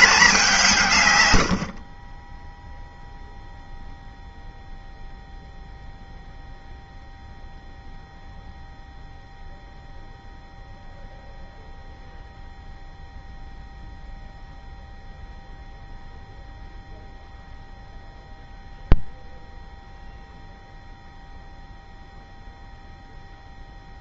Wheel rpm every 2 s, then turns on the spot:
180, 10, 0, 0, 0, 0, 0, 0, 0, 0, 0, 0.
none